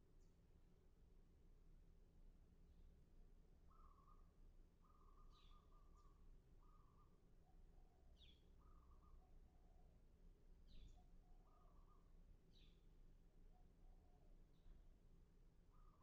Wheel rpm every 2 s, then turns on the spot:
0, 0, 0, 0, 0, 0, 0, 0.
none